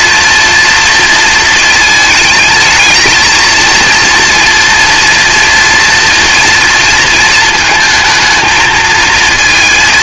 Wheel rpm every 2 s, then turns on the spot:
230, 220, 230, 230, 230.
none